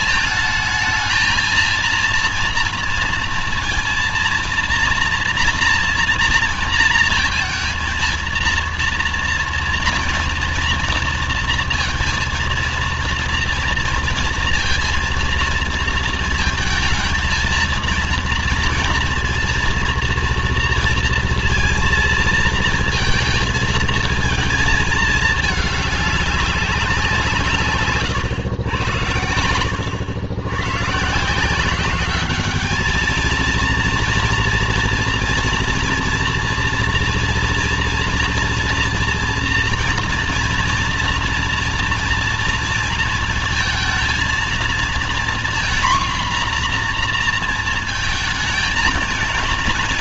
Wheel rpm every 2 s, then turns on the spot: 220, 230, 230, 230, 230, 230, 230, 230, 230, 230, 230, 230, 220, 190, 100, 130, 210, 240, 230, 230, 230, 230, 230, 240, 220.
none